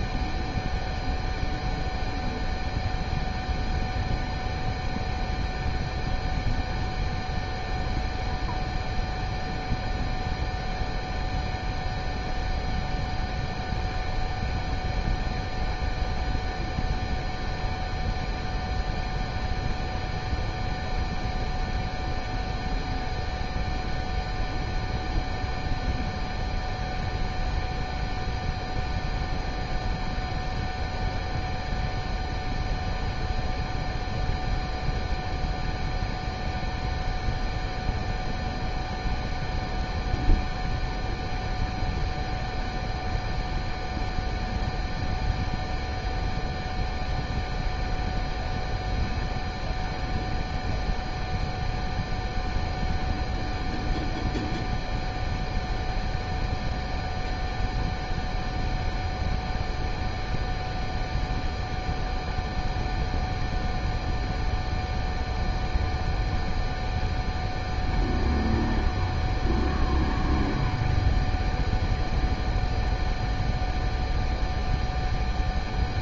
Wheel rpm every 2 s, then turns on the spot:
0, 0, 0, 0, 0, 0, 0, 0, 0, 0, 0, 0, 0, 0, 0, 0, 0, 0, 0, 0, 0, 0, 0, 0, 0, 0, 0, 0, 0, 0, 0, 0, 0, 0, 0, 0, 0, 0.
none